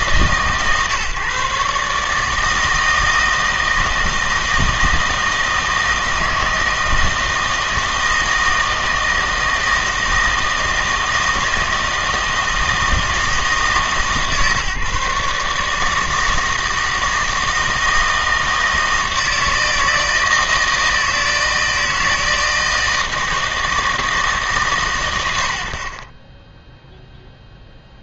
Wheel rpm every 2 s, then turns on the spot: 140, 160, 160, 160, 160, 160, 160, 150, 160, 160, 160, 160, 140, 10.
none